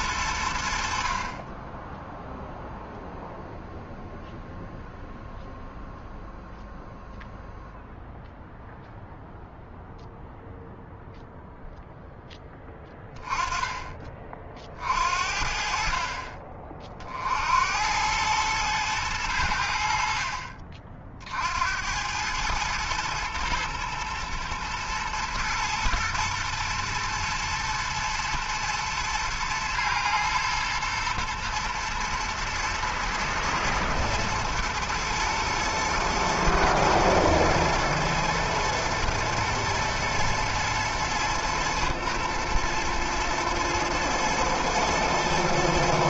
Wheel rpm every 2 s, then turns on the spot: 70, 0, 0, 0, 0, 0, 10, 50, 40, 110, 40, 110, 110, 110, 120, 120, 110, 120, 120, 110, 120, 110, 120.
none